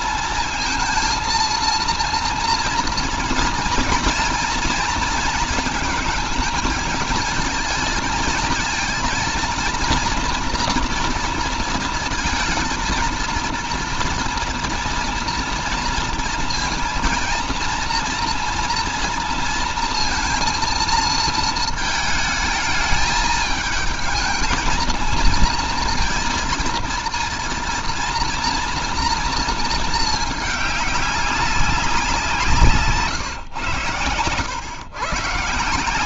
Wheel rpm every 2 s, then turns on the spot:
230, 230, 230, 220, 230, 230, 230, 230, 230, 230, 230, 210, 220, 230, 230, 200, 150, 120.
none